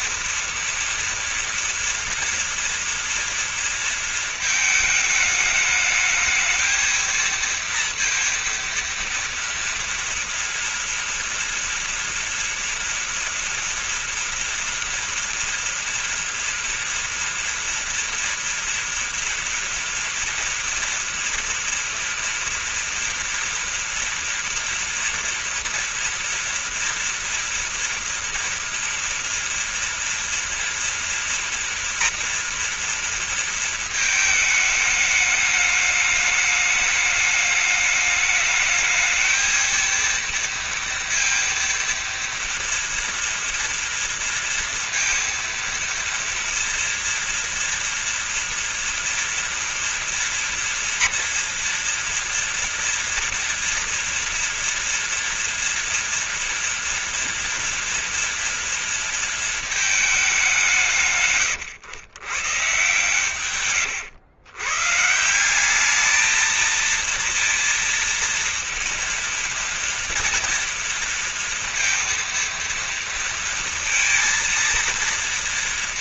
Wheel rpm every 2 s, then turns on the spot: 230, 230, 220, 230, 230, 230, 230, 230, 230, 230, 230, 230, 230, 240, 230, 230, 230, 210, 210, 220, 230, 230, 230, 230, 230, 230, 240, 240, 230, 230, 160, 140, 140, 230, 230, 230, 230, 230.
none